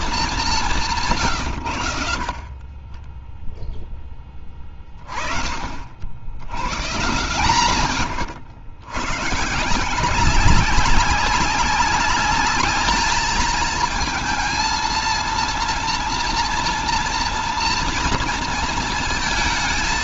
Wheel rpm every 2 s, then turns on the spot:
170, 10, 30, 130, 110, 200, 210, 230, 230, 230.
none